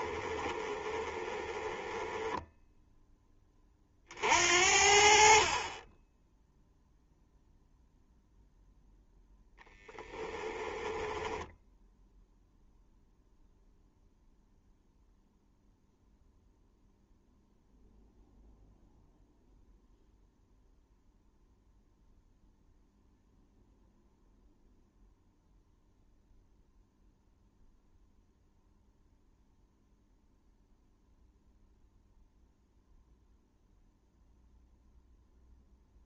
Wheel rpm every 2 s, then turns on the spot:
20, 10, 60, 0, 0, 10, 0, 0, 0, 0, 0, 0, 0, 0, 0, 0, 0, 0.
0-2 10-12